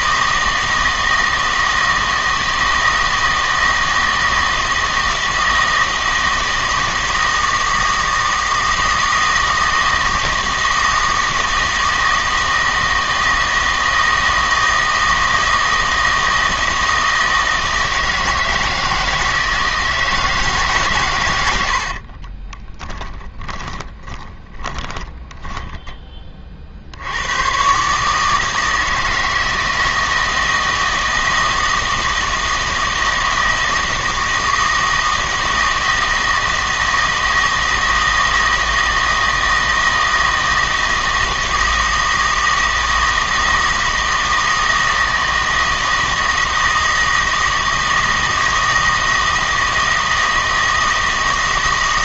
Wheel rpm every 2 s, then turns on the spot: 160, 160, 160, 160, 160, 160, 160, 160, 160, 160, 140, 20, 10, 60, 160, 160, 160, 160, 160, 160, 160, 160, 160, 160, 160, 160.
22-26